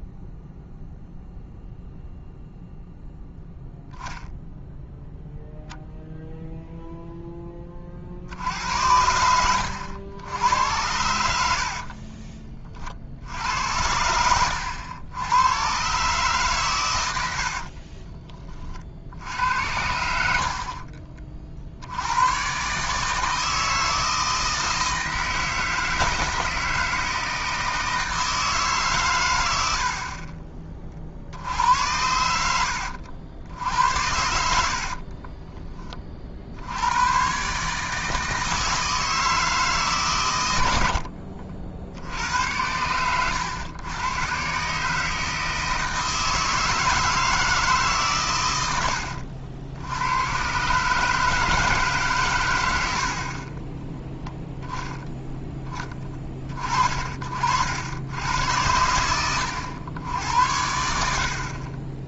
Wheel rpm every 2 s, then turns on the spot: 0, 0, 0, 0, 80, 90, 30, 90, 120, 30, 60, 130, 160, 160, 150, 30, 80, 70, 70, 160, 90, 90, 140, 160, 100, 130, 90, 10, 40, 100, 80.
8-10 34-36